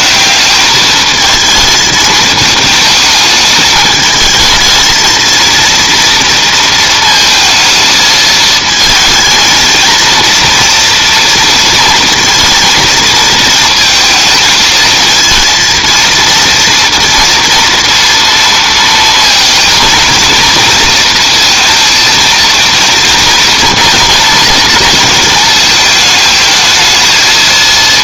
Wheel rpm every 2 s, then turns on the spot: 210, 220, 220, 230, 220, 230, 230, 220, 230, 230, 230, 230, 220, 220.
none